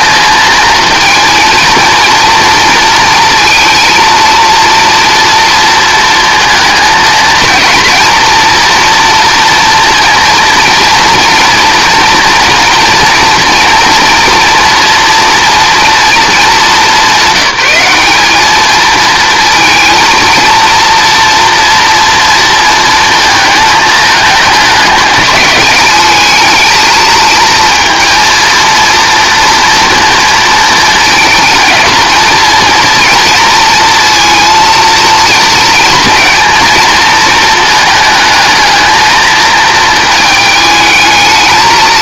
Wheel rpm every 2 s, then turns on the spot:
230, 230, 230, 230, 230, 230, 230, 240, 200, 220, 230, 230, 210, 220, 230, 220, 230, 230, 220, 220, 220.
none